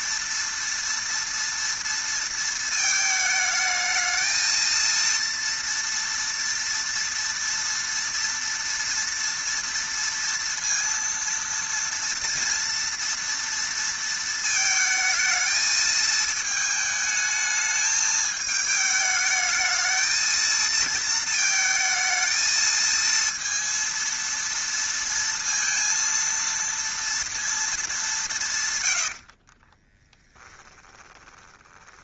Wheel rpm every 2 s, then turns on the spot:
230, 230, 230, 240, 230, 230, 230, 220, 220, 220, 230, 220, 230, 230, 140, 20.
30-32